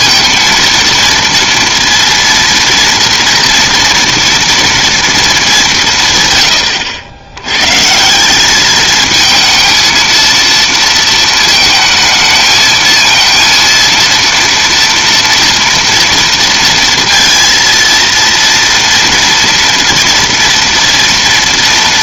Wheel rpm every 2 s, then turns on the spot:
230, 230, 230, 110, 200, 230, 220, 230, 230, 230, 230.
none